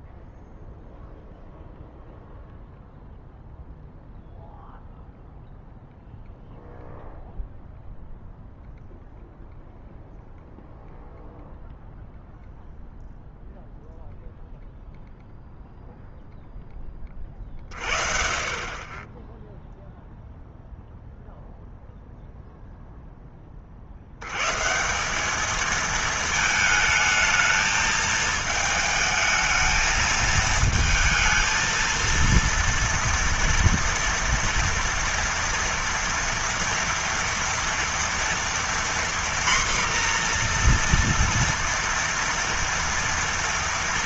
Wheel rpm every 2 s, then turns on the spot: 0, 0, 0, 0, 0, 0, 0, 0, 10, 30, 0, 0, 150, 220, 220, 220, 230, 230, 230, 240, 240, 230.
none